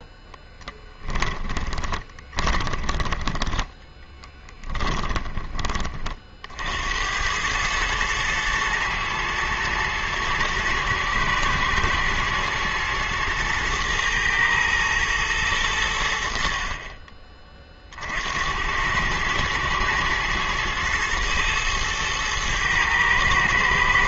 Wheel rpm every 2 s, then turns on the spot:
10, 20, 20, 80, 110, 110, 120, 110, 30, 100, 110, 110.
0-6